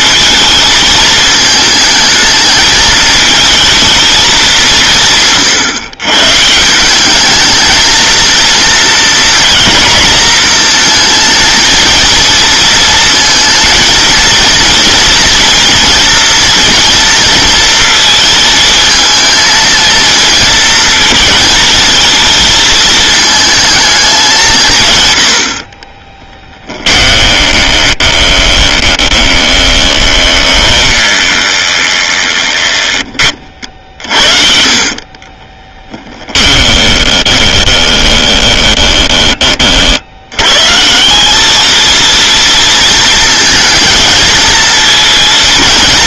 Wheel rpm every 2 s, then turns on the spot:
230, 220, 180, 170, 230, 220, 230, 230, 230, 220, 220, 230, 160, 10, 20, 20, 20, 50, 20, 20, 140, 230, 230.
26-40